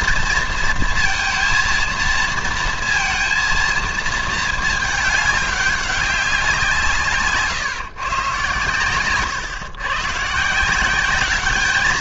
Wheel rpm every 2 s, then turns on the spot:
230, 230, 220, 170, 120, 160.
none